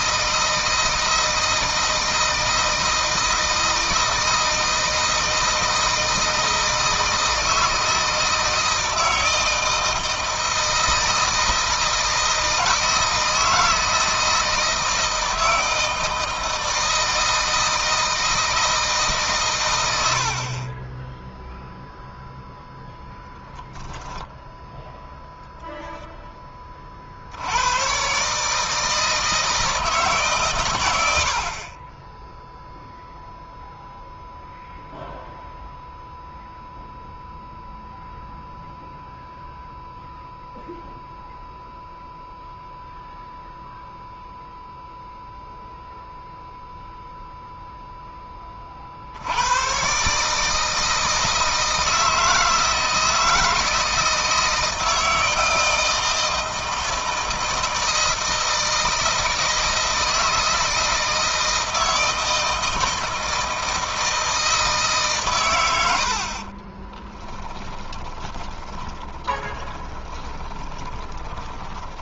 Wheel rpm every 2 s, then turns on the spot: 160, 160, 160, 160, 160, 160, 160, 160, 160, 150, 30, 0, 0, 30, 150, 120, 0, 0, 0, 0, 0, 0, 0, 0, 40, 160, 160, 160, 160, 160, 160, 160, 150, 30, 10, 20.
66-72